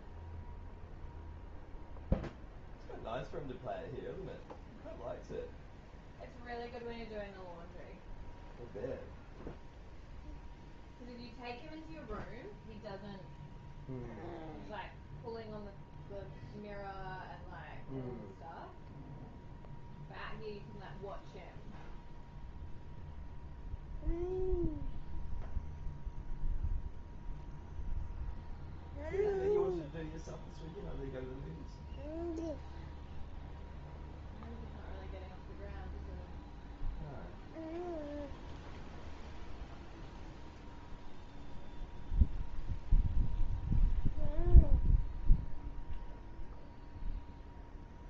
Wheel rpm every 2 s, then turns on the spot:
0, 0, 0, 0, 0, 0, 0, 0, 0, 0, 0, 0, 0, 0, 0, 0, 0, 0, 0, 0, 0, 0, 0, 0.
none